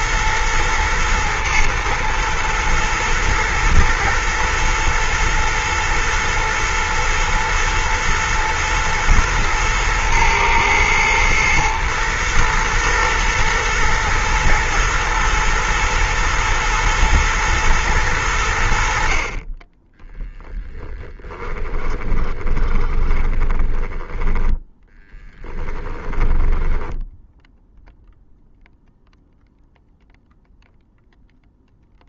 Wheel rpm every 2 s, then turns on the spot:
110, 110, 120, 110, 110, 110, 110, 120, 110, 60, 10, 20, 10, 10, 0, 0.
20-28